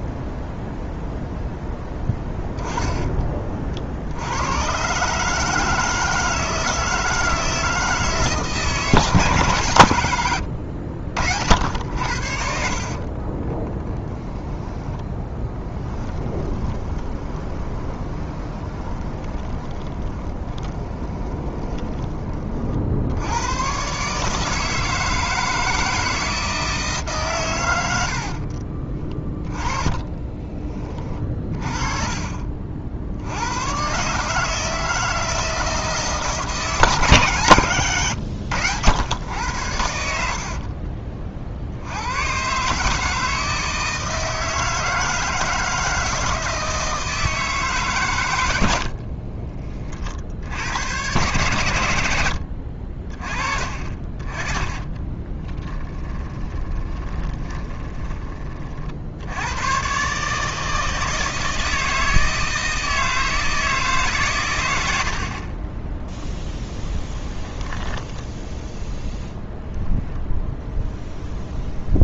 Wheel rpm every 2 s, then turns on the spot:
0, 20, 120, 160, 160, 70, 60, 20, 20, 20, 20, 50, 160, 160, 30, 20, 60, 160, 150, 100, 40, 140, 160, 160, 80, 90, 60, 20, 20, 50, 160, 160, 100, 10, 10, 0.
12-22 28-30 40-42 52-58 66-68